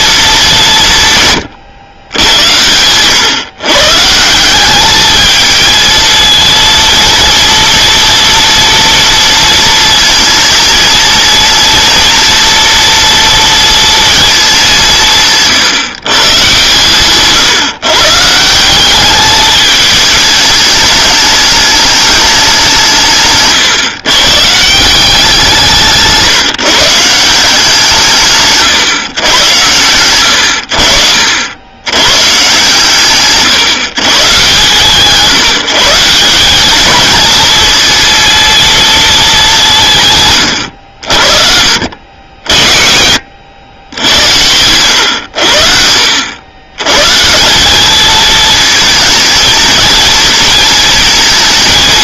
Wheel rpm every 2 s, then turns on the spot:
170, 100, 200, 230, 230, 230, 230, 190, 150, 190, 210, 170, 170, 160, 140, 80, 150, 140, 210, 230, 80, 50, 90, 110, 220, 220.
none